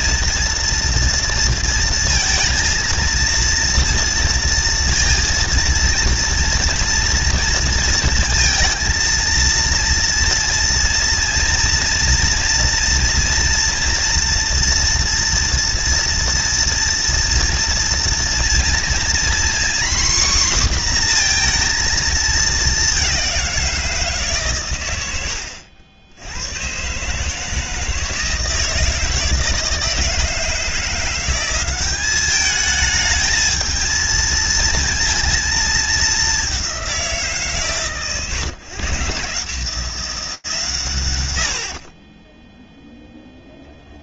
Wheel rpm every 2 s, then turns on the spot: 230, 230, 230, 230, 230, 230, 230, 240, 230, 230, 260, 220, 150, 80, 160, 160, 200, 230, 210, 140, 150, 20.
none